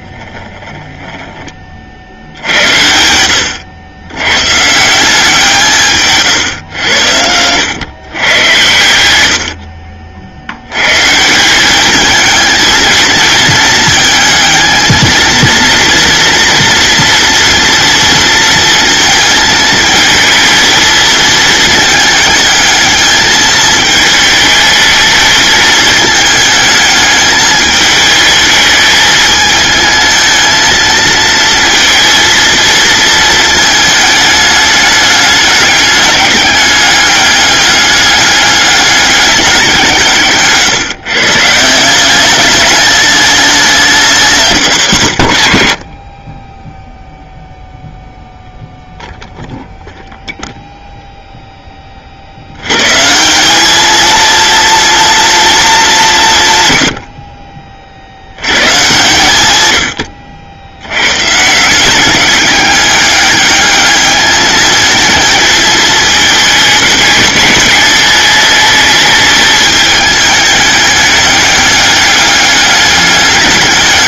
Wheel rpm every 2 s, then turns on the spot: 10, 80, 150, 100, 90, 100, 220, 220, 240, 230, 220, 220, 220, 220, 220, 220, 220, 210, 200, 200, 160, 200, 150, 10, 0, 0, 110, 230, 100, 120, 90, 200, 220, 210, 210, 210, 210.
none